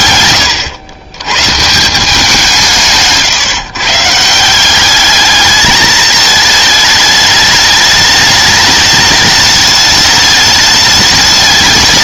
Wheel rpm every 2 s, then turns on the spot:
110, 170, 180, 210, 210, 210.
none